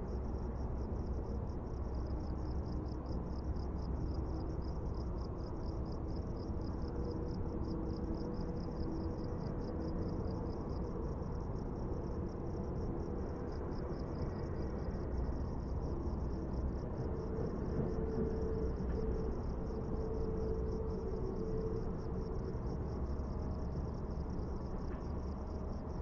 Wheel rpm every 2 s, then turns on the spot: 0, 0, 0, 0, 0, 0, 0, 0, 0, 0, 0, 0, 0.
none